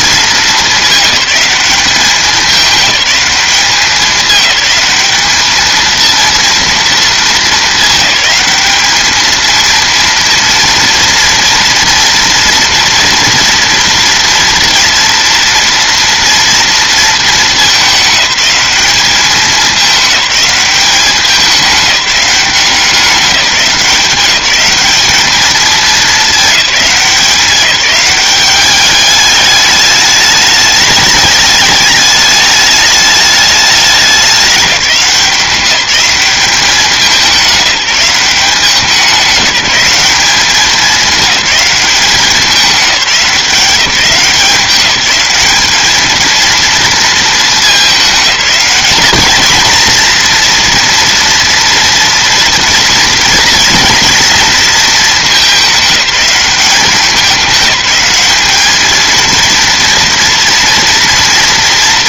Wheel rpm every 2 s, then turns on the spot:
210, 210, 210, 220, 210, 230, 230, 230, 230, 210, 200, 190, 200, 190, 200, 210, 210, 190, 200, 190, 210, 190, 200, 230, 210, 240, 240, 220, 200, 220, 230.
none